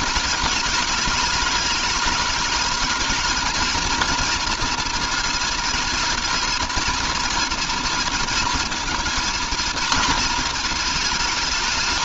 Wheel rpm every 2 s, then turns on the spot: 210, 230, 230, 230, 230, 220.
none